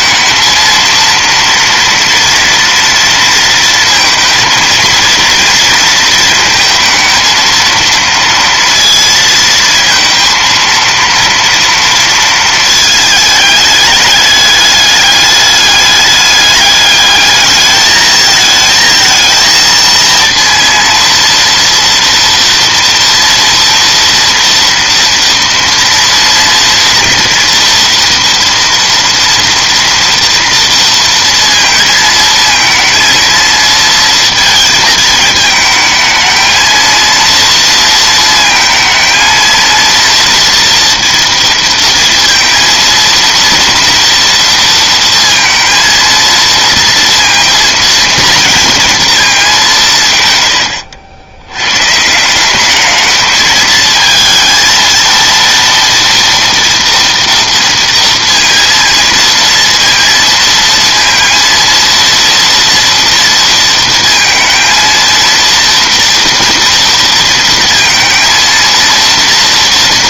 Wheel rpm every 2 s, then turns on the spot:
230, 230, 230, 230, 230, 230, 210, 200, 220, 230, 230, 240, 230, 240, 230, 230, 230, 220, 230, 230, 230, 230, 230, 230, 180, 110, 220, 230, 230, 230, 230, 230, 230, 230, 230.
none